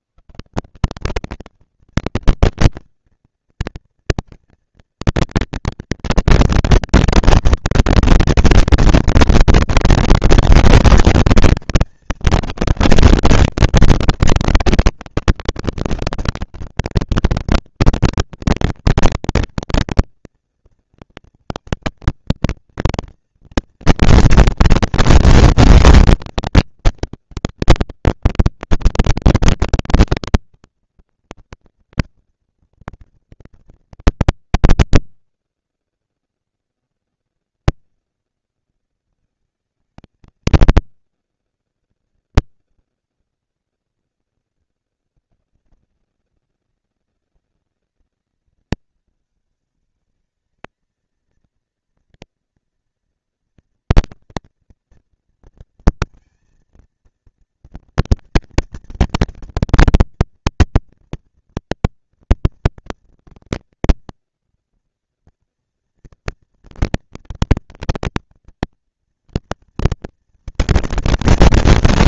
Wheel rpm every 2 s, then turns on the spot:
130, 220, 230, 230, 240, 230, 210, 200, 200, 230, 230, 230, 230, 230, 230, 230, 230, 230, 240, 230, 220, 230, 220, 200, 190, 210, 230, 230, 230, 230, 230, 230, 230, 230, 230, 230.
none